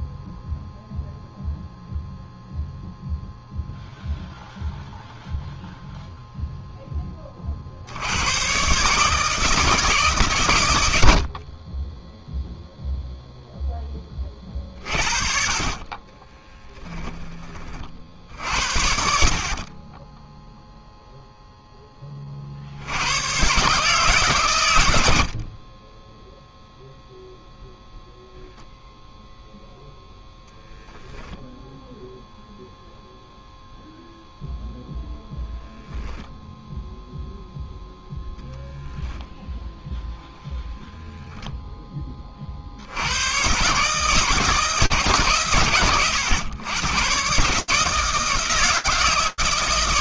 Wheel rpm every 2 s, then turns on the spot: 0, 0, 0, 30, 150, 50, 0, 40, 40, 30, 10, 140, 30, 0, 0, 0, 0, 0, 0, 0, 0, 120, 130, 130, 160.
none